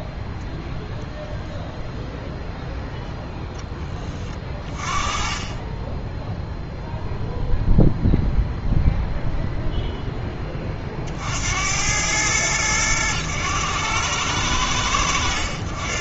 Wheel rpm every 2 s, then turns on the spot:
10, 0, 20, 0, 0, 20, 100, 100.
none